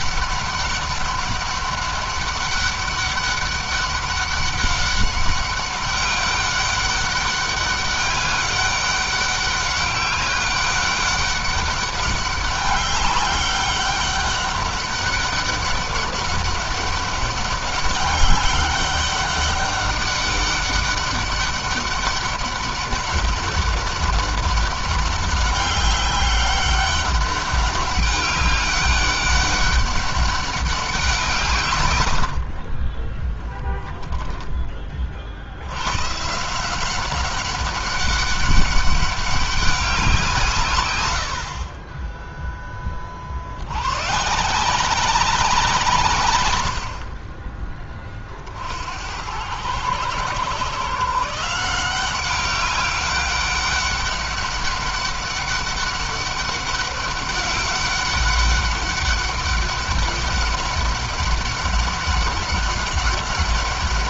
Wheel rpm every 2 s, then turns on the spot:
200, 200, 200, 200, 200, 200, 200, 200, 190, 200, 200, 200, 200, 200, 200, 190, 40, 30, 170, 200, 120, 20, 180, 80, 80, 150, 200, 200, 190, 200, 200, 200.
40-42